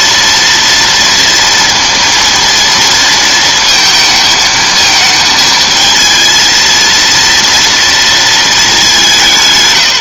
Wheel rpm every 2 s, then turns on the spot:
230, 230, 220, 230, 210.
none